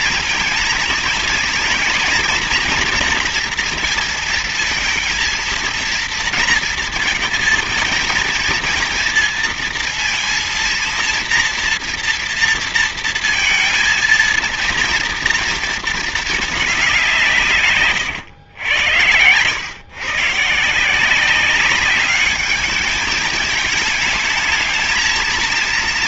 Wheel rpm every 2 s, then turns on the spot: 230, 230, 230, 220, 230, 230, 230, 230, 200, 110, 150, 210, 220.
none